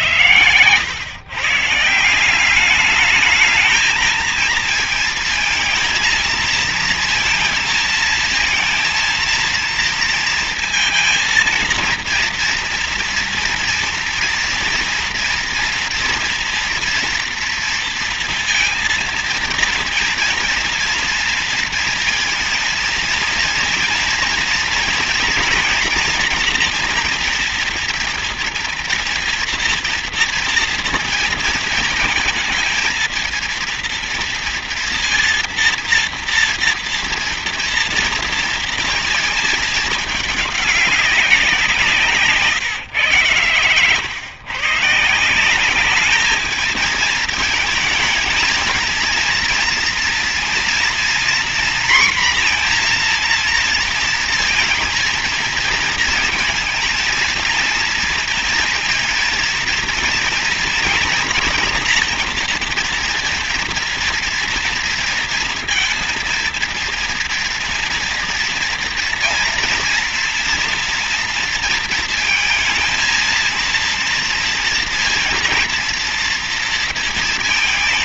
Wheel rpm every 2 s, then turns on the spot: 120, 190, 220, 230, 230, 230, 230, 230, 240, 230, 230, 230, 240, 240, 240, 230, 220, 230, 240, 230, 210, 140, 130, 220, 230, 230, 240, 230, 230, 230, 230, 240, 230, 230, 240, 240, 230, 230, 230.
none